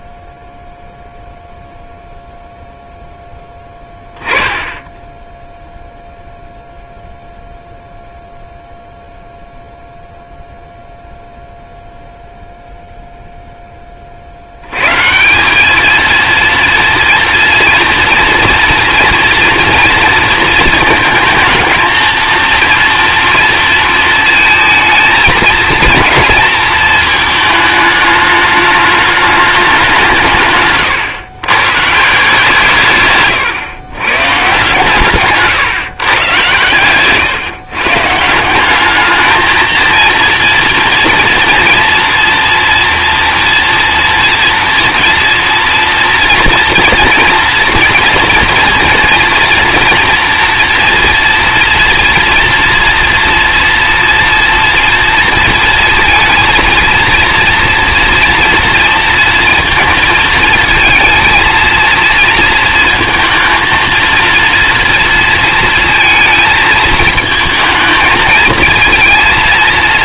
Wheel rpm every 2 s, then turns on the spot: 0, 0, 0, 0, 0, 0, 20, 200, 230, 230, 220, 230, 230, 210, 200, 130, 120, 140, 140, 220, 230, 240, 230, 230, 230, 230, 240, 230, 230, 230, 230, 230, 230, 220, 230.
none